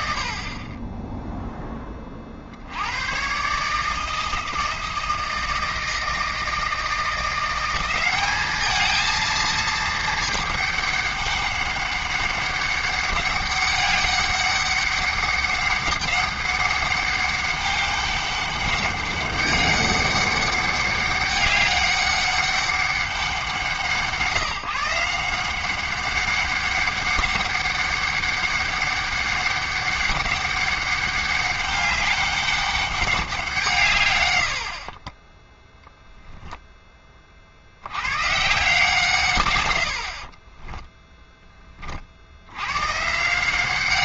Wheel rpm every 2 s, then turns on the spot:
10, 110, 160, 170, 220, 200, 200, 200, 200, 200, 200, 190, 170, 200, 200, 200, 200, 60, 10, 150, 20, 110.
40-42